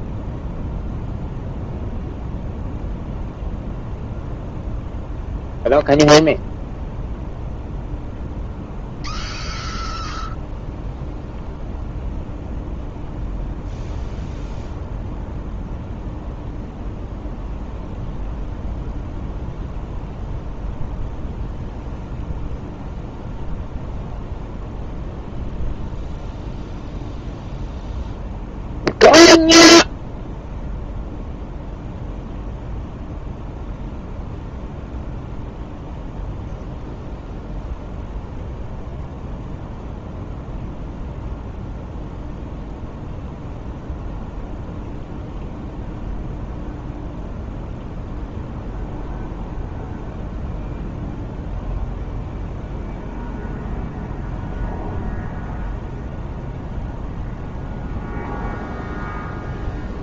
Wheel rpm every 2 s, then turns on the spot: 0, 0, 0, 0, 0, 0, 0, 0, 0, 0, 0, 0, 0, 0, 0, 0, 0, 0, 0, 0, 0, 0, 0, 0, 0, 0, 0, 0, 0, 0.
none